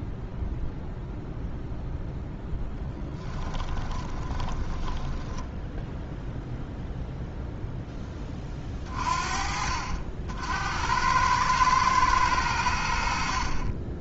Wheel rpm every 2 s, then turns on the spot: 0, 20, 10, 0, 40, 110, 40.
2-6